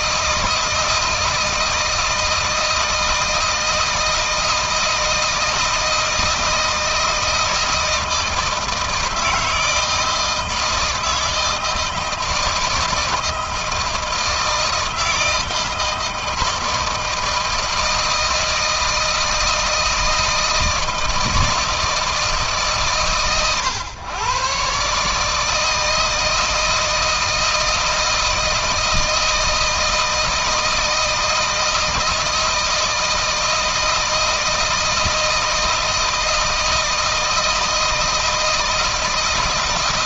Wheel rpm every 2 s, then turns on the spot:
160, 160, 160, 160, 160, 160, 160, 160, 160, 160, 160, 140, 150, 160, 160, 160, 160, 160, 160, 160.
none